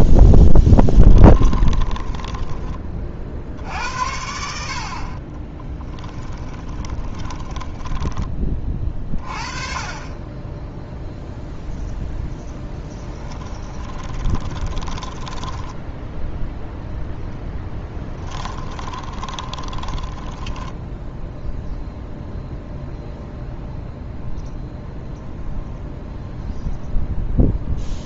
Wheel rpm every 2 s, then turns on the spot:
20, 20, 50, 20, 30, 10, 10, 20, 10, 20, 10, 0, 0, 0.
0-2 6-8 12-16 18-22